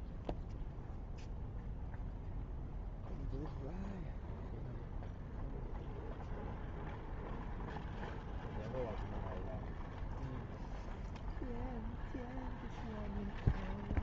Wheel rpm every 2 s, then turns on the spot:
0, 0, 0, 0, 0, 0, 0.
none